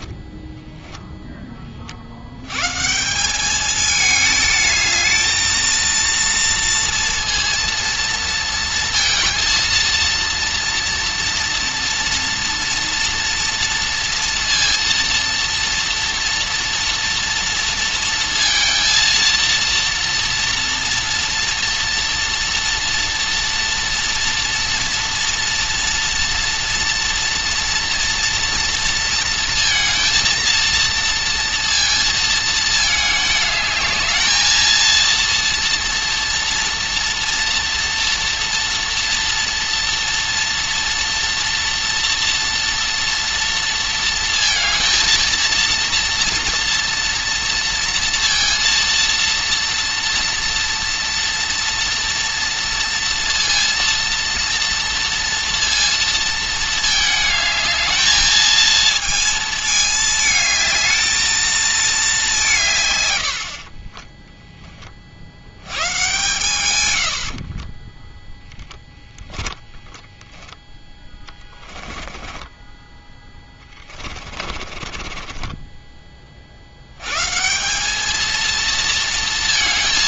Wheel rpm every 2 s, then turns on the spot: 0, 130, 220, 230, 230, 240, 230, 230, 240, 230, 230, 230, 230, 240, 230, 230, 220, 230, 230, 230, 220, 230, 230, 230, 230, 230, 230, 230, 220, 220, 220, 130, 20, 110, 10, 10, 10, 30, 90, 230.
68-70 72-76